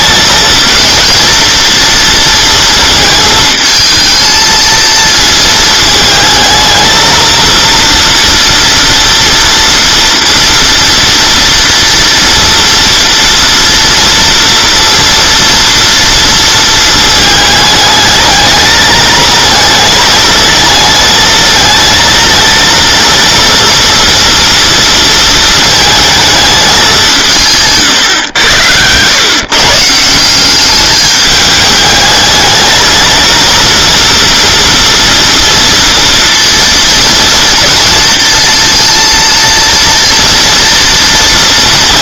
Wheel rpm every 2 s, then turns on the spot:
220, 230, 230, 220, 230, 230, 230, 230, 220, 210, 220, 230, 230, 210, 110, 200, 220, 230, 230, 230, 230.
28-30